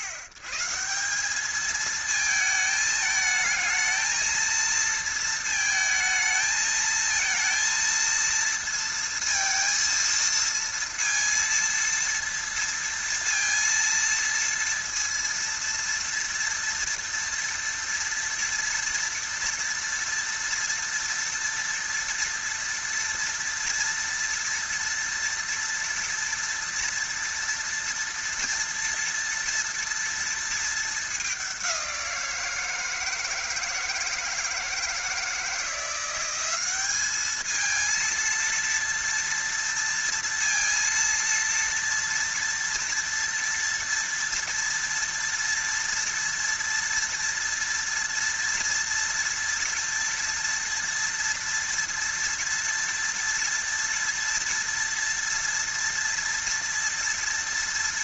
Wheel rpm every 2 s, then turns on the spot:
130, 220, 230, 220, 230, 230, 230, 230, 230, 230, 230, 230, 240, 230, 230, 220, 170, 170, 190, 230, 230, 230, 230, 230, 230, 230, 230, 230, 230.
none